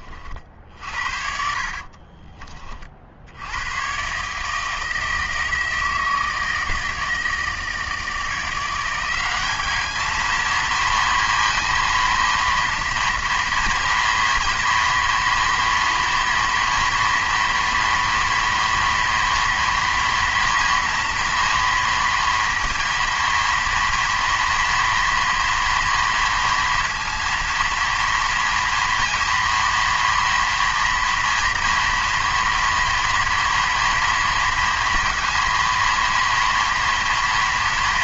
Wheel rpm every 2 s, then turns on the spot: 50, 40, 160, 160, 170, 230, 230, 230, 230, 230, 230, 230, 230, 230, 240, 230, 230, 230, 230.
0-2